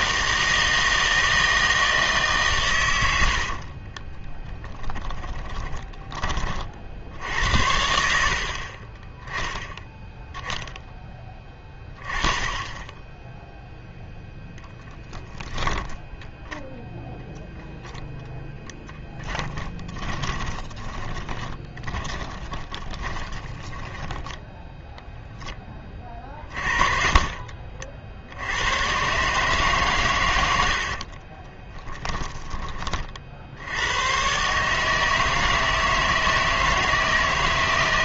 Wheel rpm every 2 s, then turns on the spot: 160, 130, 20, 40, 50, 10, 10, 0, 0, 0, 20, 20, 10, 40, 100, 70, 30, 150, 160.
4-6 20-24 26-28